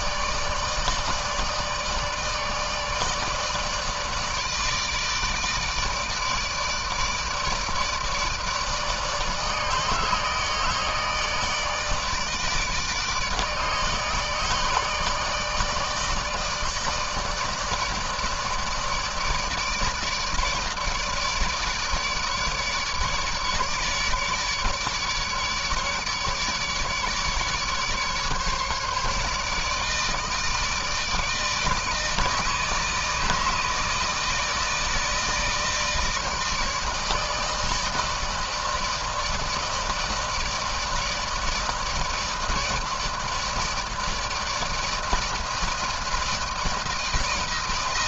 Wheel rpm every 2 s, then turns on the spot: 150, 150, 150, 160, 160, 160, 150, 150, 150, 160, 150, 150, 150, 150, 150, 160, 160, 160, 160, 160, 160, 160, 160, 160.
none